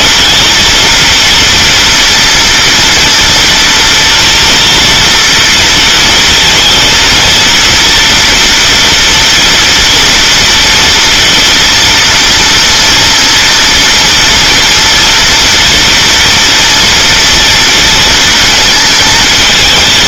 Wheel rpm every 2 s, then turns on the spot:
230, 230, 230, 230, 230, 240, 230, 230, 240, 230.
none